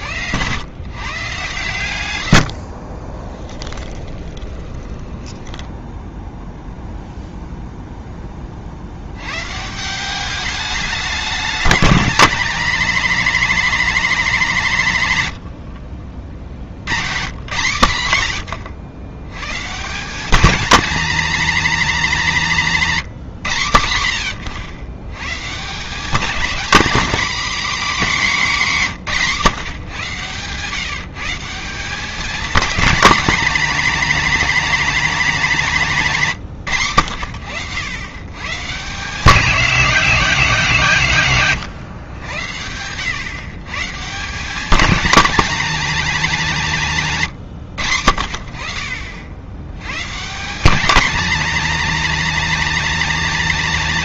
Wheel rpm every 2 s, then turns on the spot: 120, 50, 20, 0, 60, 200, 210, 190, 70, 100, 220, 190, 100, 220, 210, 140, 210, 230, 100, 140, 170, 90, 210, 190, 60, 200, 240.
2-6